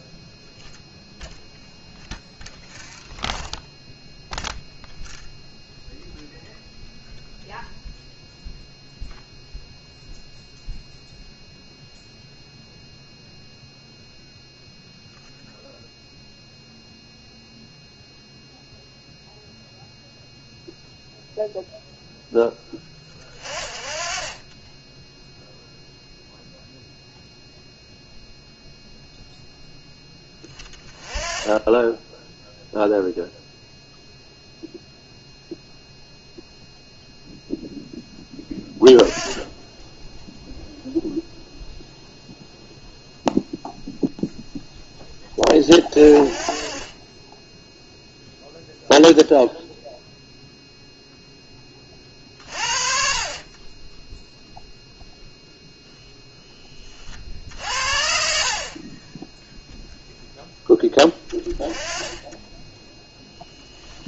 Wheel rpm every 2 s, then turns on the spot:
0, 0, 0, 0, 0, 0, 0, 0, 0, 0, 0, 0, 10, 0, 0, 10, 0, 0, 0, 10, 0, 0, 0, 30, 0, 0, 50, 0, 10, 50, 10, 10.
none